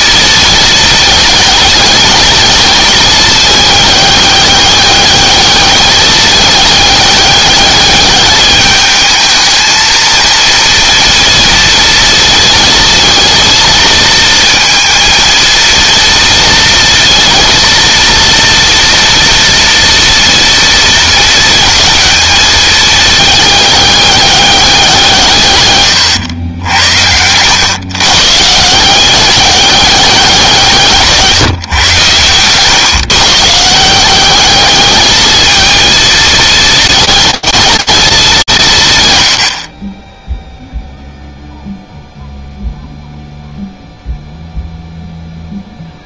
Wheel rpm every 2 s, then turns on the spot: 220, 210, 200, 210, 210, 230, 220, 230, 230, 230, 230, 220, 180, 90, 170, 170, 120, 210, 220, 140, 0, 0, 0.
none